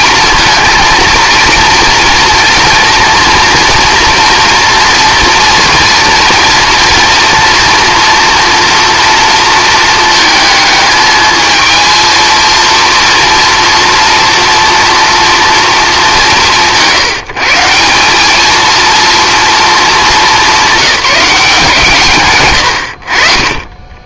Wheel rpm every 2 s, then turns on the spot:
230, 230, 230, 230, 240, 220, 230, 230, 170, 220, 200, 90.
22-24